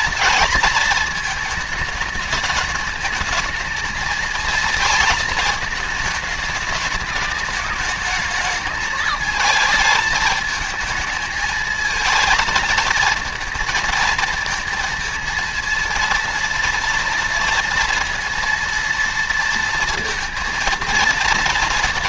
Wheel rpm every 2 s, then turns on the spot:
220, 210, 220, 210, 220, 220, 230, 230, 230, 230, 230.
none